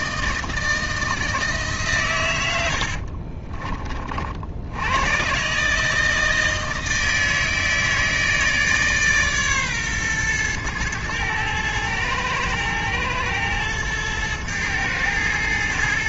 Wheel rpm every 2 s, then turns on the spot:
160, 70, 90, 160, 150, 110, 110, 110.
2-4